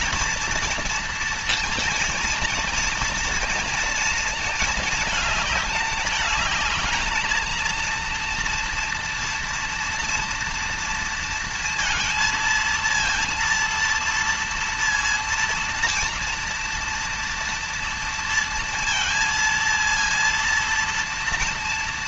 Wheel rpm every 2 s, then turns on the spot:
230, 230, 220, 220, 230, 230, 230, 230, 230, 230, 230.
none